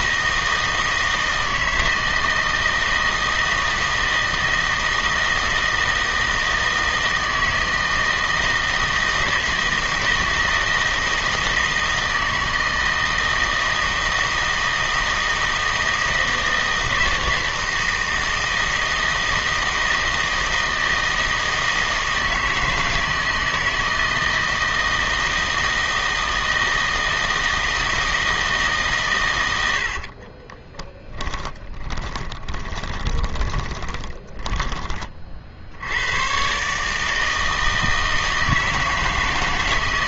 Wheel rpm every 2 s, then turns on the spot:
160, 160, 160, 160, 160, 160, 160, 160, 160, 160, 160, 160, 160, 160, 150, 10, 20, 20, 140, 160.
30-34